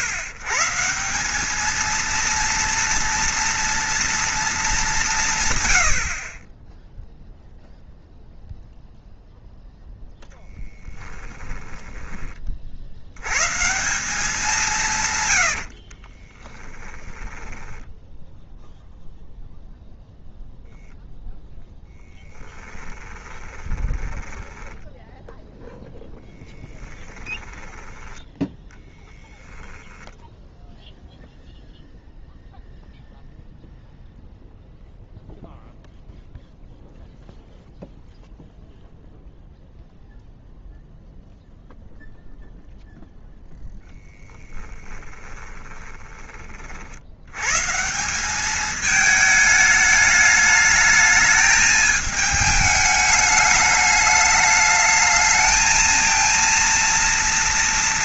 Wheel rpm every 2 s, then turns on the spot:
140, 230, 210, 10, 0, 10, 50, 180, 10, 0, 0, 10, 20, 10, 10, 0, 0, 0, 0, 0, 0, 0, 20, 40, 210, 210, 220, 210, 230.
10-12 16-18 22-28 44-46